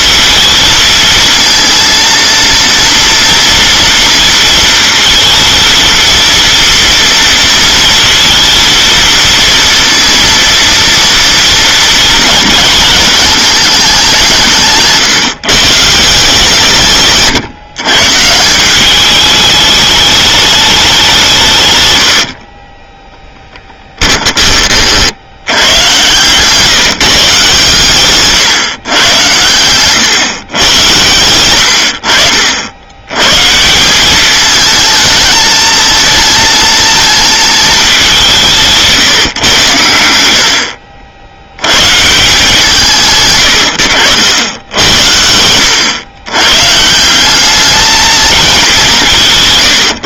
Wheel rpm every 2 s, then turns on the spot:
230, 230, 230, 230, 230, 230, 210, 170, 160, 170, 210, 50, 20, 150, 150, 110, 70, 210, 220, 180, 90, 170, 90, 130, 210.
22-24 26-30